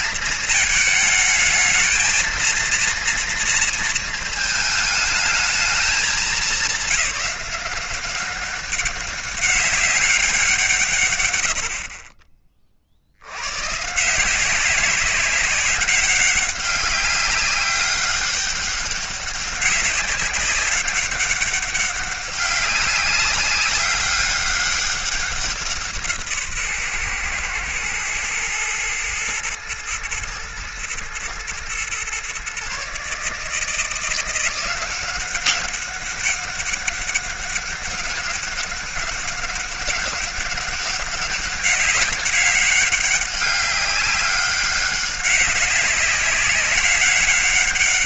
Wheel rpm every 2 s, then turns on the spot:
220, 230, 220, 190, 190, 140, 40, 190, 190, 200, 200, 200, 200, 130, 110, 110, 140, 180, 200, 200, 200, 200, 190, 190.
none